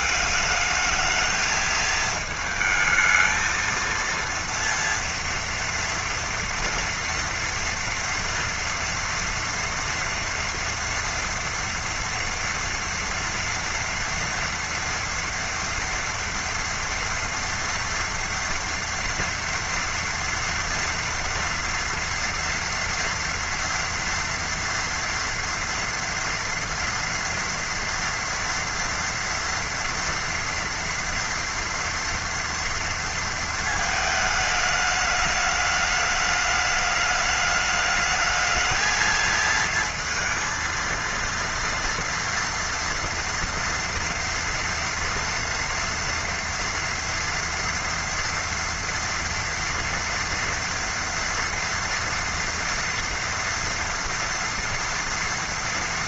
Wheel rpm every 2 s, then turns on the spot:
210, 220, 230, 230, 240, 230, 230, 230, 230, 230, 230, 230, 230, 230, 230, 230, 230, 210, 210, 220, 230, 230, 230, 230, 230, 230, 230, 230.
none